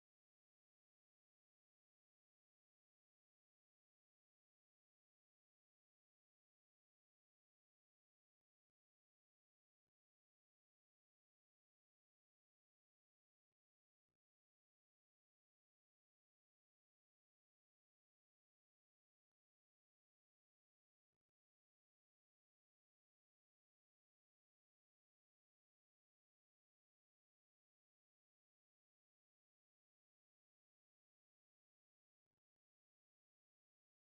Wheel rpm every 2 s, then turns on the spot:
0, 0, 0, 0, 0, 0, 0, 0, 0, 0, 0, 0, 0, 0, 0, 0, 0.
none